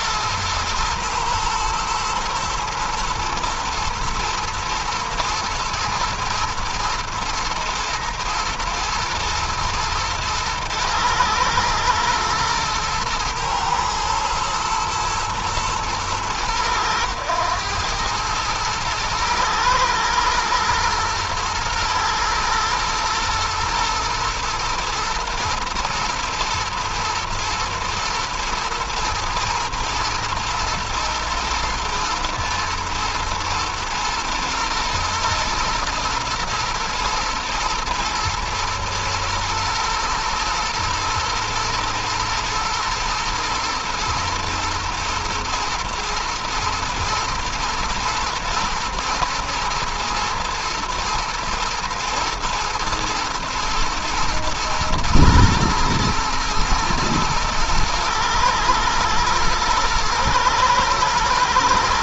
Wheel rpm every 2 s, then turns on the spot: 120, 110, 120, 120, 120, 110, 110, 120, 100, 110, 110, 110, 110, 120, 120, 120, 120, 120, 110, 110, 120, 120, 120, 110, 110, 110, 110, 120, 110, 110, 110.
none